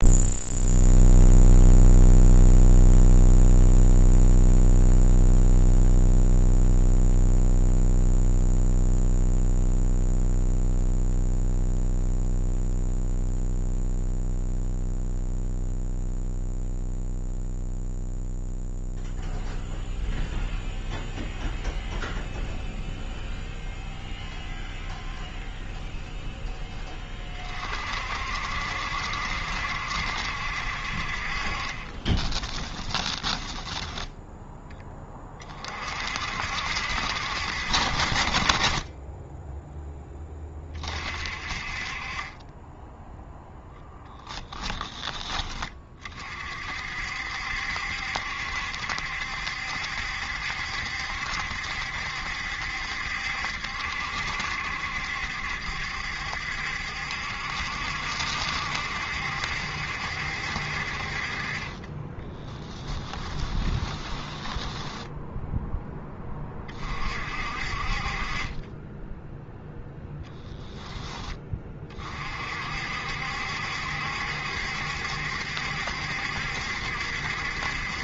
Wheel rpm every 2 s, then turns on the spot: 0, 0, 0, 0, 0, 0, 0, 0, 0, 0, 0, 0, 0, 10, 70, 50, 10, 10, 60, 30, 30, 10, 20, 60, 70, 70, 70, 70, 70, 70, 50, 10, 10, 40, 10, 10, 60, 70, 70.
32-34 62-66